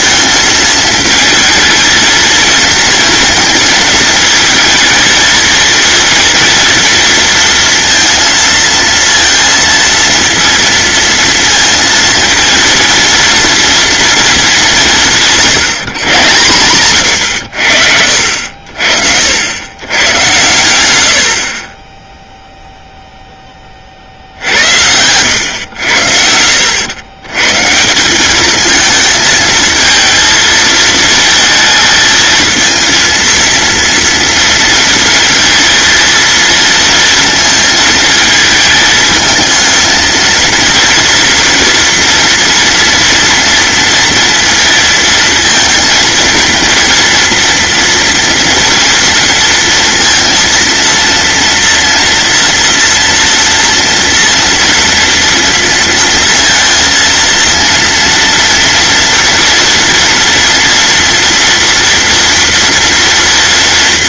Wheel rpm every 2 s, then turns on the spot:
220, 230, 230, 230, 230, 230, 230, 170, 110, 50, 90, 0, 90, 100, 220, 230, 230, 230, 230, 220, 230, 230, 230, 230, 230, 230, 230, 230, 230, 240, 230, 230.
16-18